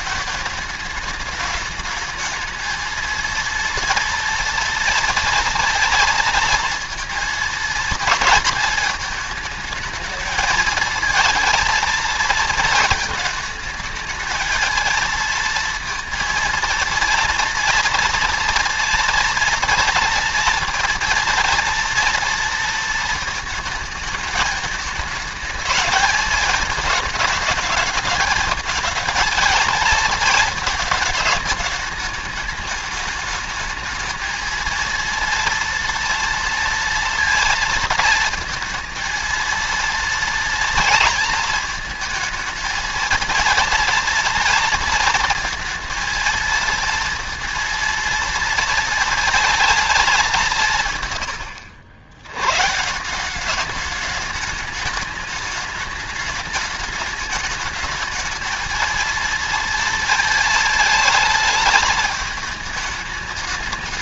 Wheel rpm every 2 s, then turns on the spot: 210, 220, 230, 230, 230, 220, 230, 220, 230, 230, 230, 230, 220, 220, 220, 220, 210, 230, 230, 230, 230, 230, 230, 230, 230, 150, 140, 210, 210, 220, 220, 210.
none